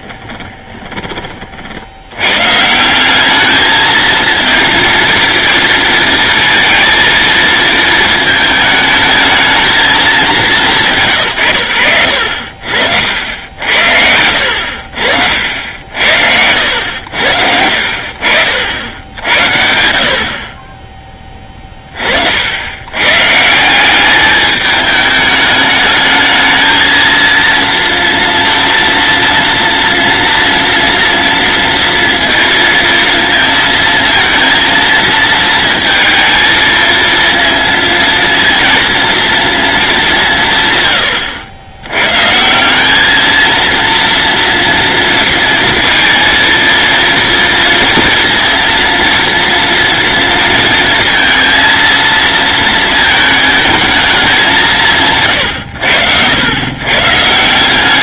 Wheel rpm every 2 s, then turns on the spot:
20, 160, 230, 230, 220, 170, 70, 60, 80, 70, 20, 100, 210, 230, 230, 230, 230, 230, 230, 230, 110, 190, 230, 230, 230, 230, 220, 170, 120.
none